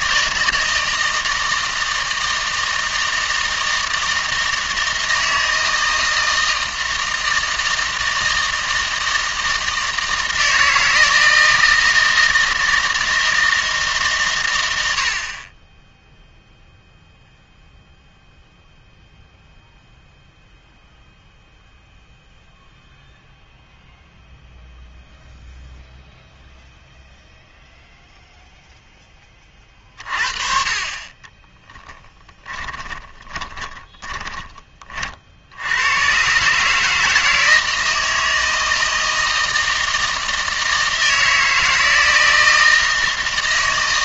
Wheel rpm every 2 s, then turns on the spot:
160, 160, 160, 160, 160, 160, 160, 90, 0, 0, 0, 0, 0, 0, 0, 30, 20, 30, 150, 160, 160, 160.
32-34